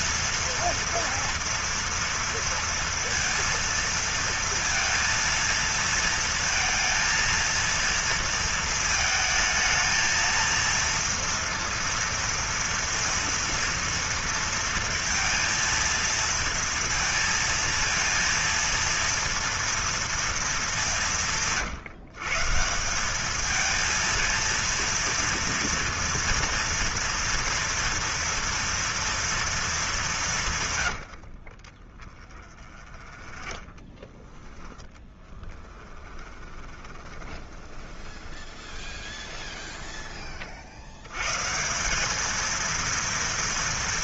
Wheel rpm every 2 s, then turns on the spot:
230, 230, 230, 230, 230, 230, 230, 230, 230, 230, 220, 150, 230, 230, 240, 160, 30, 10, 10, 20, 30, 220.
32-34 36-40